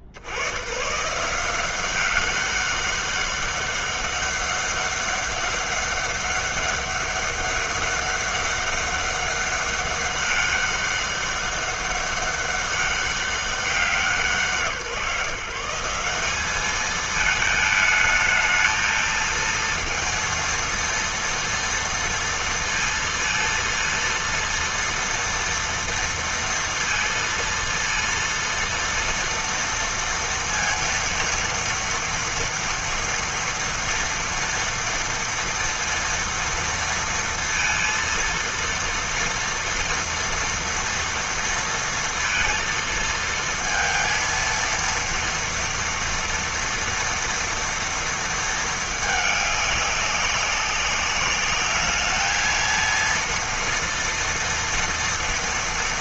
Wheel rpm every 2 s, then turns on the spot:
60, 190, 200, 200, 200, 200, 200, 150, 200, 220, 230, 230, 230, 230, 230, 230, 240, 230, 230, 230, 230, 230, 230, 230, 230, 190, 220, 230.
none